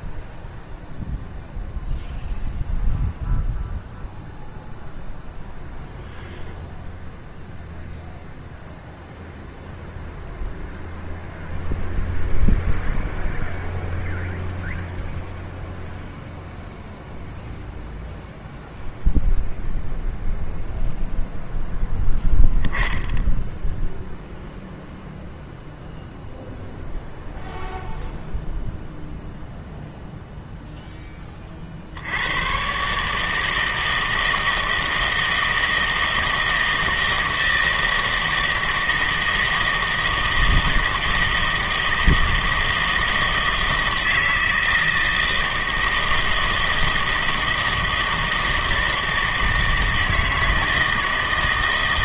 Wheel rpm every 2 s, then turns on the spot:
0, 0, 0, 0, 0, 0, 0, 0, 0, 0, 0, 10, 0, 0, 0, 0, 120, 160, 160, 160, 160, 160, 160, 160, 160, 160.
none